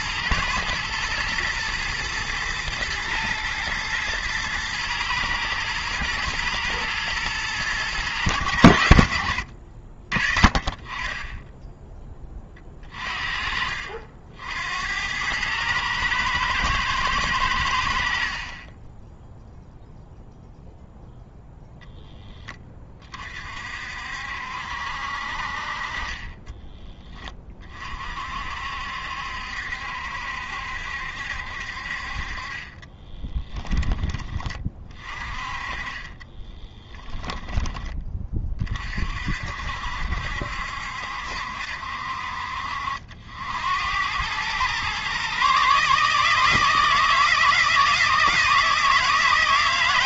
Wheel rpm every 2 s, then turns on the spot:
120, 110, 110, 110, 90, 20, 30, 90, 110, 20, 0, 20, 60, 10, 60, 70, 20, 40, 10, 40, 70, 60, 120, 160, 160.
32-34 36-38